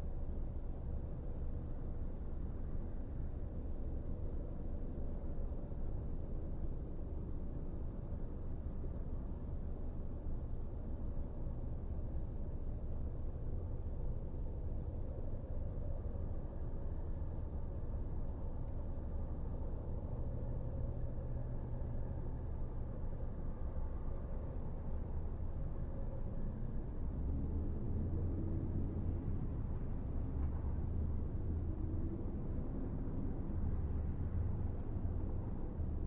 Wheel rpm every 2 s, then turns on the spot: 0, 0, 0, 0, 0, 0, 0, 0, 0, 0, 0, 0, 0, 0, 0, 0, 0, 0.
none